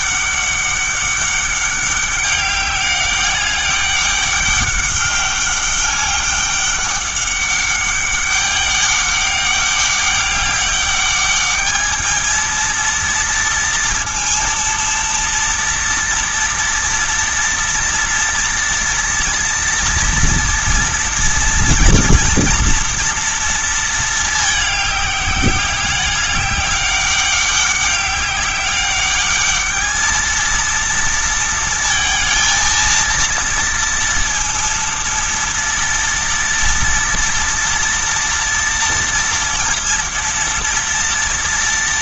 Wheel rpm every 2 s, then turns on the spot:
200, 200, 200, 200, 200, 200, 220, 230, 230, 230, 240, 230, 210, 200, 200, 230, 230, 230, 230, 230, 230.
none